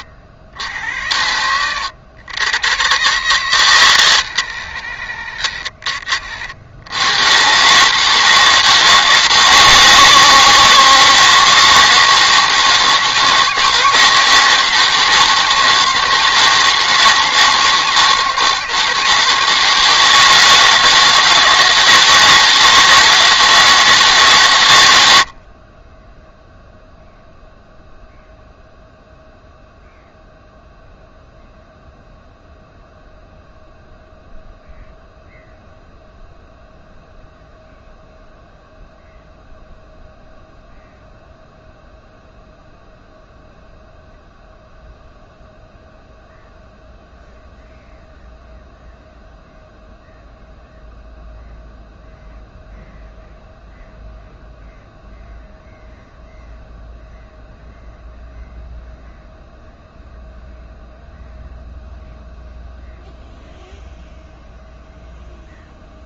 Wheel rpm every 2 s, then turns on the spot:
80, 110, 150, 70, 150, 150, 160, 160, 150, 160, 160, 160, 120, 0, 0, 0, 0, 0, 0, 0, 0, 0, 0, 0, 0, 0, 0, 0, 0, 0, 0, 0, 0.
none